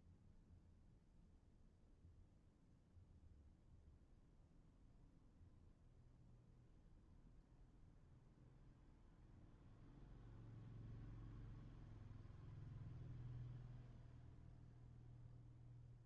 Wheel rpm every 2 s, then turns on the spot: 0, 0, 0, 0, 0, 0, 0, 0.
none